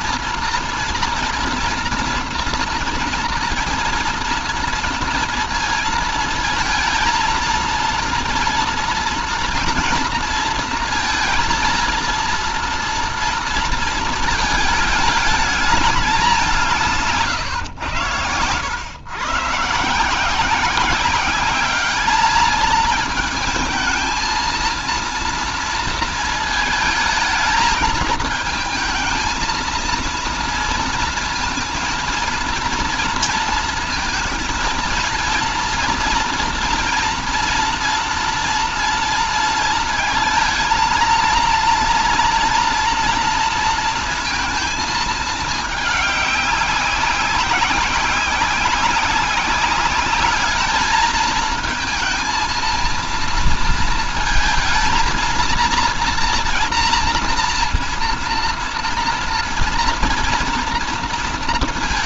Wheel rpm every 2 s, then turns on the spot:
230, 240, 230, 230, 230, 230, 230, 220, 190, 120, 170, 220, 230, 220, 220, 230, 230, 230, 230, 230, 230, 230, 220, 200, 190, 210, 230, 220, 230, 230, 230.
none